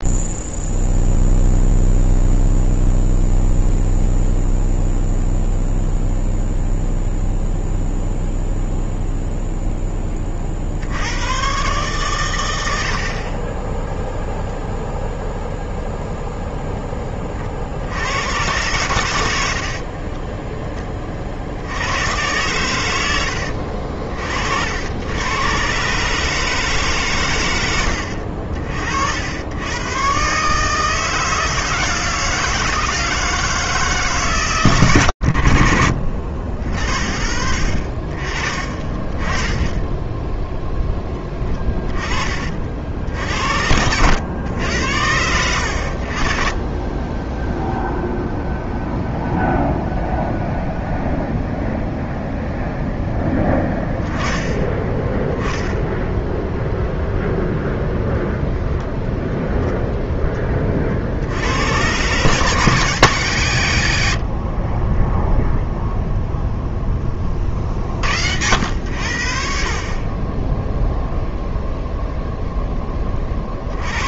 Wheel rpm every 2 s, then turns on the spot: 0, 0, 0, 0, 0, 50, 90, 0, 0, 100, 20, 110, 70, 150, 60, 150, 160, 110, 60, 30, 10, 50, 100, 30, 0, 0, 0, 10, 0, 0, 30, 150, 40, 0, 80, 10, 0.
64-66